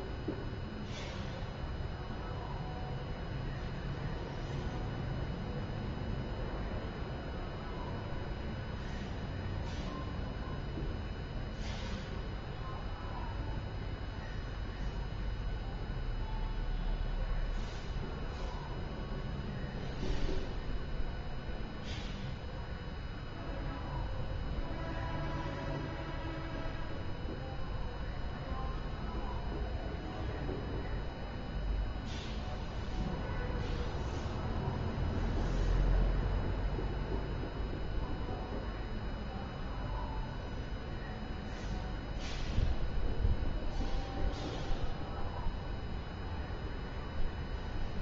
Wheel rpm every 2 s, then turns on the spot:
0, 0, 0, 0, 0, 0, 0, 0, 0, 0, 0, 0, 0, 0, 0, 0, 0, 0, 0, 0, 0, 0, 0, 0.
none